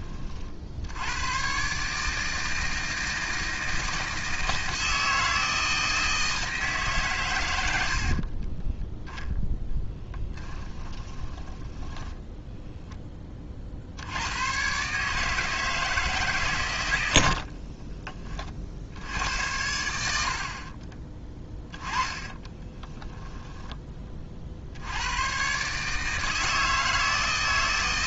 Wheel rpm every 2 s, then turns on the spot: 70, 160, 160, 150, 10, 20, 10, 130, 110, 50, 40, 20, 70, 160.
8-12 20-24